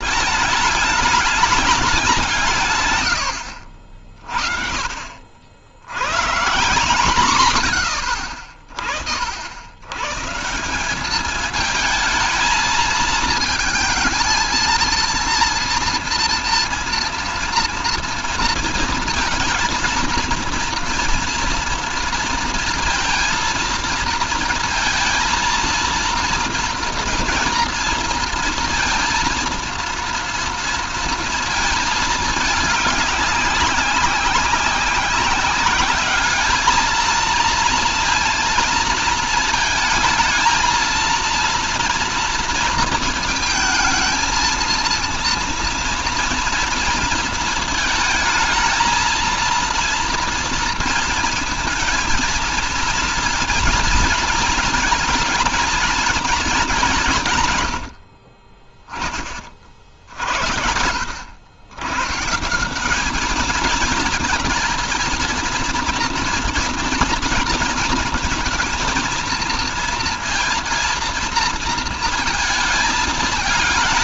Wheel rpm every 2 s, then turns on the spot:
210, 130, 40, 140, 50, 170, 220, 230, 230, 230, 230, 230, 230, 230, 230, 230, 210, 190, 210, 230, 230, 230, 230, 230, 220, 230, 230, 220, 200, 40, 70, 180, 230, 230, 230, 230, 220.
none